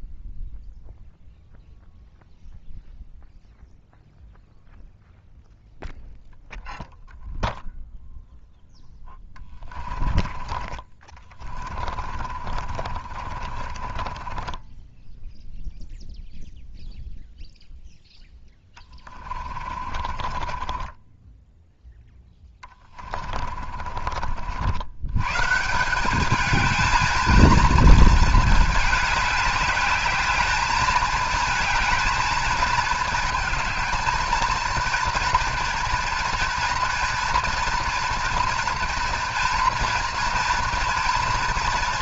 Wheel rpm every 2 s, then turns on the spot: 0, 0, 0, 0, 0, 30, 50, 20, 0, 10, 20, 20, 70, 220, 220, 220, 220, 220, 230, 230, 230.
10-16 18-24